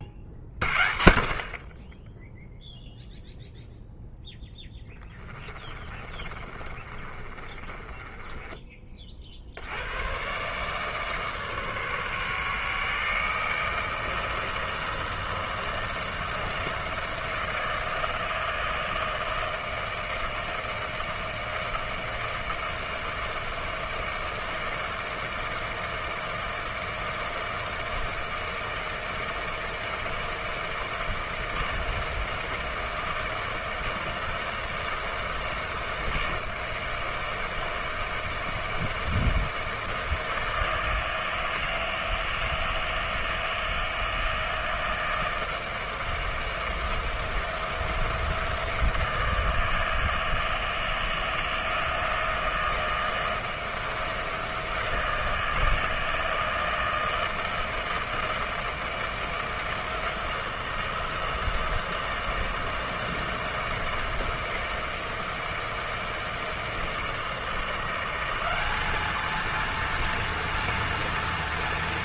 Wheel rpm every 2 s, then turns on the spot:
50, 0, 10, 30, 20, 150, 150, 160, 160, 160, 160, 160, 160, 160, 160, 160, 160, 160, 160, 160, 160, 160, 160, 160, 170, 160, 160, 160, 160, 160, 170, 160, 160, 160, 200, 230.
4-8